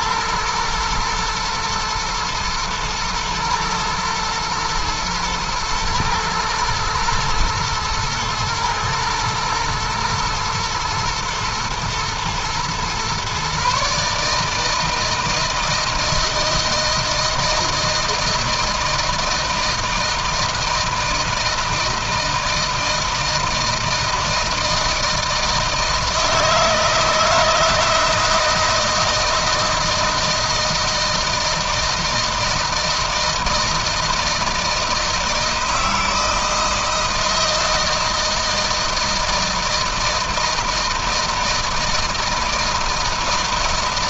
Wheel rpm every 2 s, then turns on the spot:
120, 110, 110, 120, 120, 110, 120, 160, 160, 160, 160, 160, 160, 160, 160, 160, 160, 160, 160, 160, 160, 160.
none